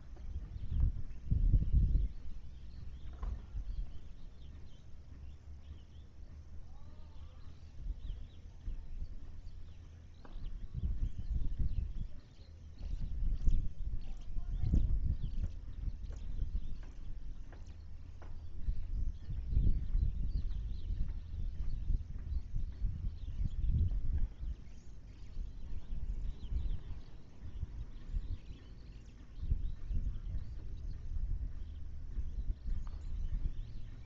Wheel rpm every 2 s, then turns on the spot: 0, 0, 0, 0, 0, 0, 0, 0, 0, 0, 0, 0, 0, 0, 0, 0, 0.
none